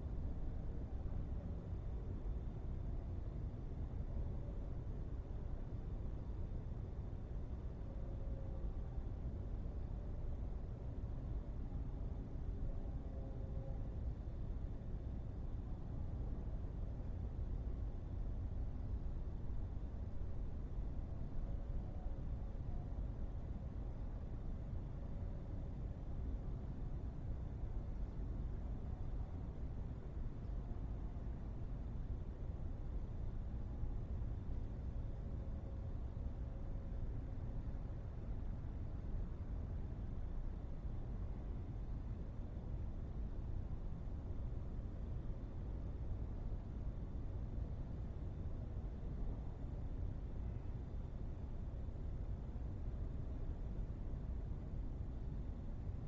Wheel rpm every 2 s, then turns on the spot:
0, 0, 0, 0, 0, 0, 0, 0, 0, 0, 0, 0, 0, 0, 0, 0, 0, 0, 0, 0, 0, 0, 0, 0, 0, 0, 0, 0.
none